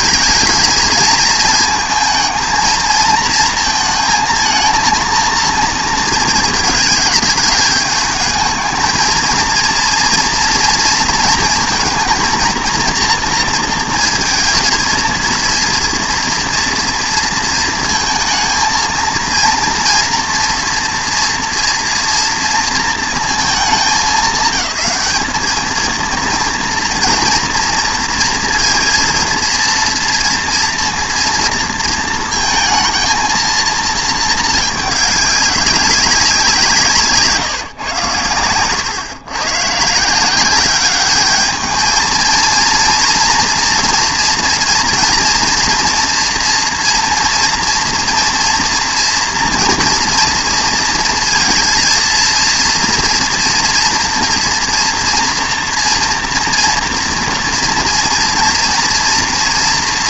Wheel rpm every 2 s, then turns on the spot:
230, 230, 230, 210, 230, 230, 230, 230, 230, 230, 240, 220, 210, 240, 230, 230, 220, 210, 150, 110, 200, 230, 230, 230, 230, 230, 230, 230, 230, 230.
none